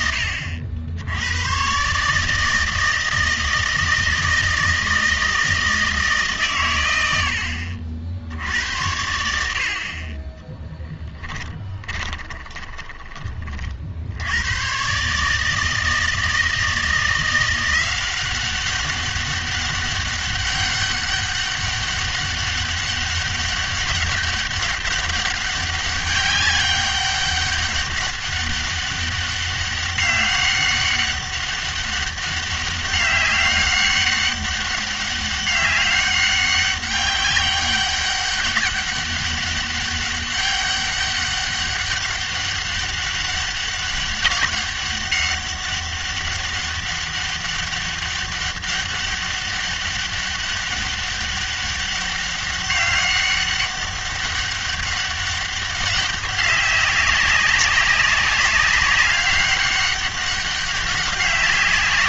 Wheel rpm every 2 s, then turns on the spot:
70, 160, 160, 110, 80, 10, 10, 110, 160, 190, 200, 200, 200, 200, 200, 200, 200, 200, 200, 200, 200, 200, 200, 200, 200, 200, 200, 200, 190, 200, 200.
10-14